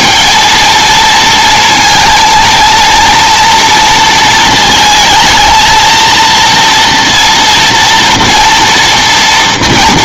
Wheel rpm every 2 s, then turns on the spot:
220, 230, 220, 230, 230.
none